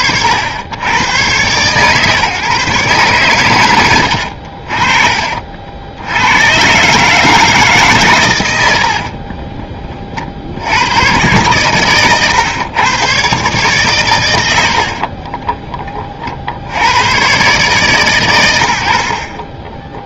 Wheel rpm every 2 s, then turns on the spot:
100, 130, 40, 120, 80, 80, 110, 70, 70, 100.
8-10 14-16